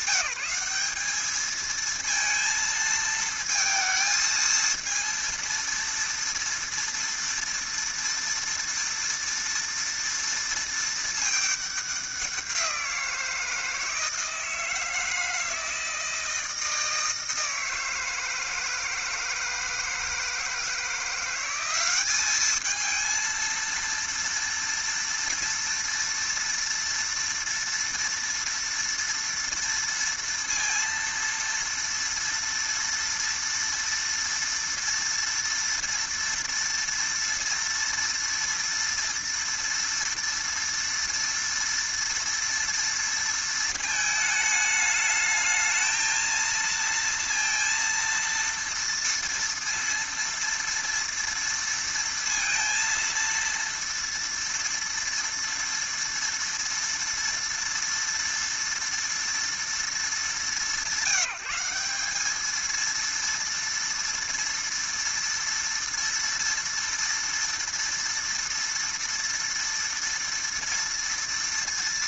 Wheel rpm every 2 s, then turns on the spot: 200, 230, 230, 230, 230, 230, 180, 160, 160, 160, 160, 210, 230, 230, 230, 230, 230, 230, 230, 240, 230, 230, 210, 230, 230, 230, 230, 230, 230, 230, 200, 220, 230, 230, 230, 230.
none